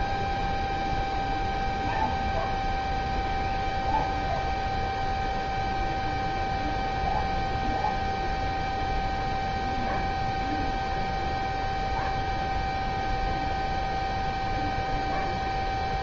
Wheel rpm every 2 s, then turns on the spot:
0, 0, 0, 0, 0, 0, 0, 0.
none